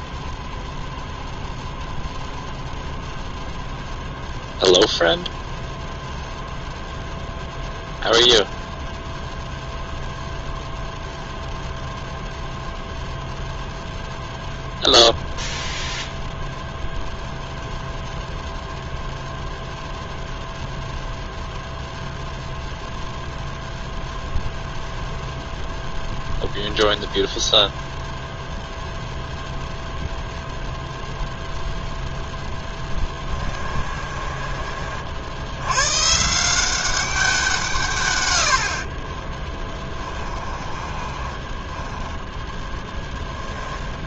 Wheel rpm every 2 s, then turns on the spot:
0, 0, 0, 0, 0, 0, 0, 0, 0, 0, 0, 0, 0, 0, 0, 0, 10, 30, 170, 70, 30, 10.
32-34 40-42